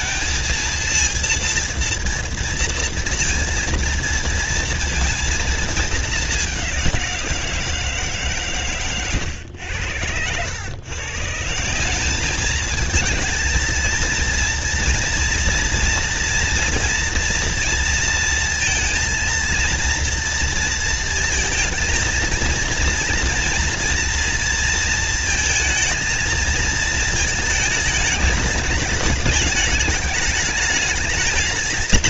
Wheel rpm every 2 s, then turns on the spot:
230, 230, 230, 180, 120, 150, 220, 230, 230, 230, 220, 230, 230, 220, 210, 220.
none